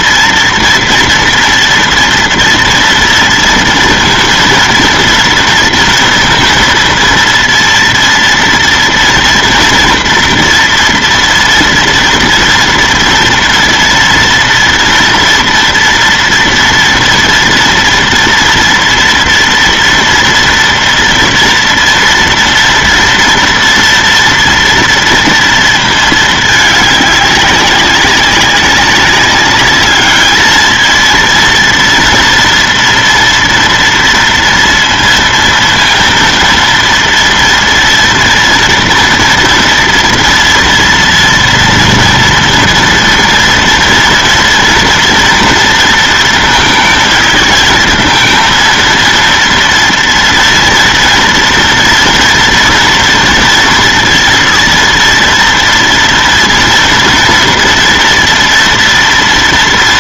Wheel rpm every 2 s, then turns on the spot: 240, 230, 230, 230, 230, 230, 230, 230, 230, 230, 230, 230, 230, 220, 200, 220, 230, 230, 230, 230, 230, 230, 230, 230, 230, 230, 230, 240, 230, 230.
none